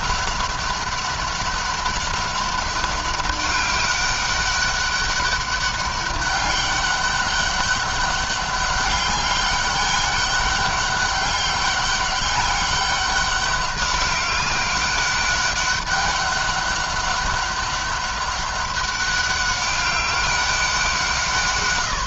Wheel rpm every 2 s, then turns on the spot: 200, 200, 200, 200, 200, 200, 200, 190, 190, 200, 190.
none